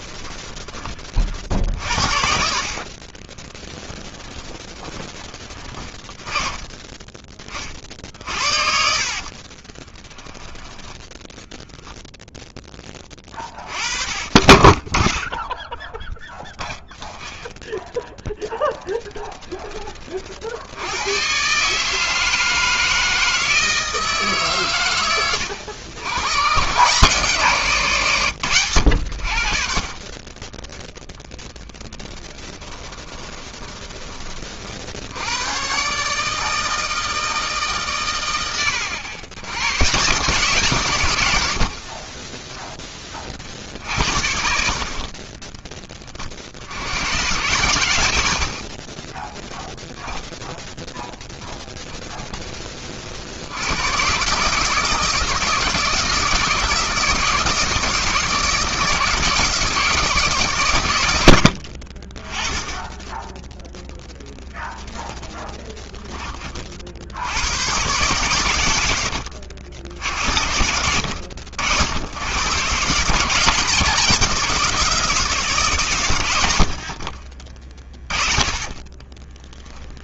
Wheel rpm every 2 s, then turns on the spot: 20, 50, 10, 20, 60, 10, 10, 20, 0, 10, 80, 160, 120, 120, 90, 10, 20, 50, 160, 90, 130, 10, 50, 80, 50, 10, 40, 160, 160, 160, 90, 10, 10, 70, 90, 80, 150, 170, 60, 30.
2-6 8-10 18-20 32-34 48-52 76-80